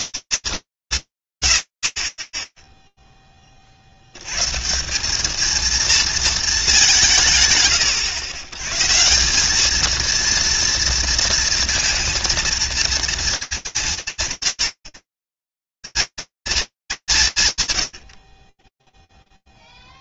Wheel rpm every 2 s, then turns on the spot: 170, 0, 170, 190, 140, 230, 230, 150, 220, 40.
none